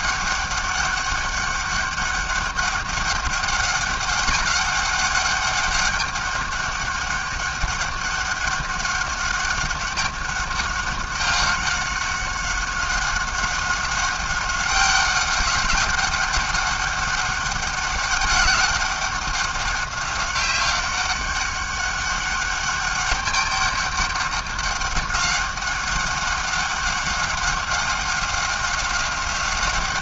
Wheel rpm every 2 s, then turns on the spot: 200, 200, 200, 200, 200, 200, 190, 190, 200, 190, 200, 200, 190, 200, 190.
none